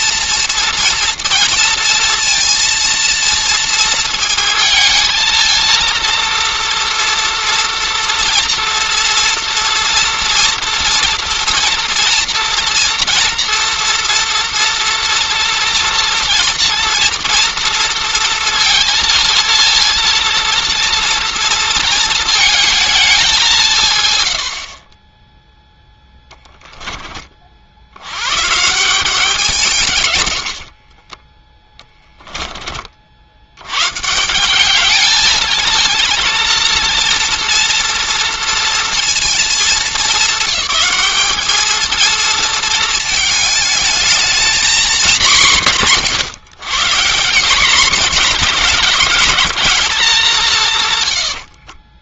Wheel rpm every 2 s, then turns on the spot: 230, 230, 220, 230, 230, 230, 230, 230, 230, 230, 230, 210, 30, 20, 170, 40, 50, 210, 230, 230, 200, 220, 220, 160, 210, 150.
24-26 30-32